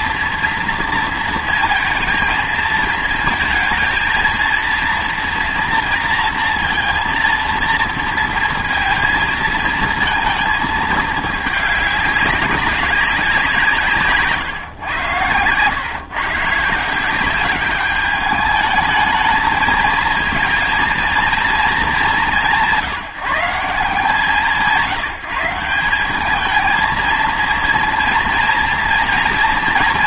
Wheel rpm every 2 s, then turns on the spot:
230, 220, 230, 230, 230, 220, 200, 130, 160, 210, 220, 180, 160, 220, 230.
none